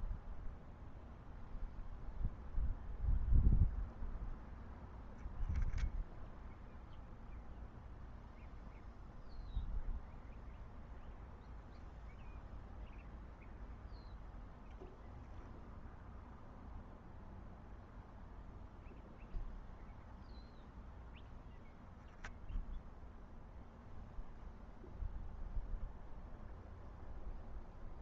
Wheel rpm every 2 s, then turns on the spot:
0, 0, 0, 0, 0, 0, 0, 0, 0, 0, 0, 0, 0, 0.
none